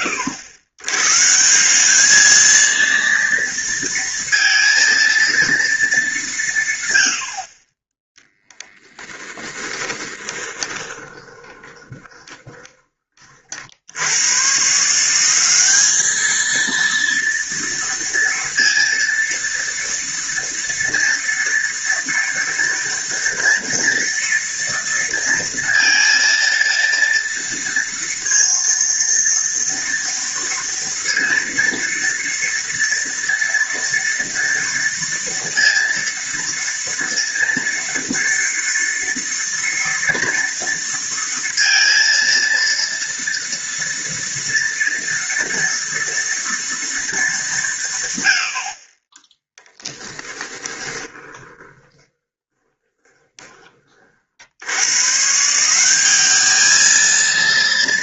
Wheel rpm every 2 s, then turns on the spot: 100, 230, 230, 120, 10, 20, 30, 160, 230, 230, 230, 230, 230, 230, 230, 230, 230, 230, 230, 230, 230, 230, 230, 230, 40, 30, 20, 120, 220.
10-12 50-54